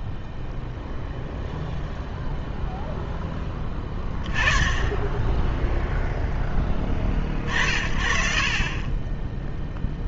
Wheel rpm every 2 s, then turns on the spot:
0, 0, 20, 0, 20.
none